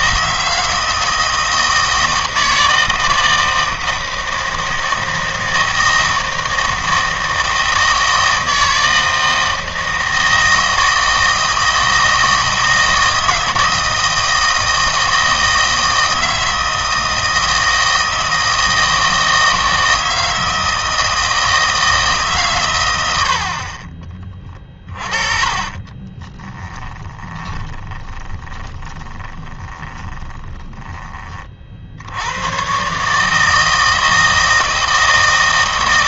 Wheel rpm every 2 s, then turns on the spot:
160, 160, 160, 160, 160, 160, 160, 160, 160, 160, 160, 130, 20, 10, 10, 10, 120, 160.
24-30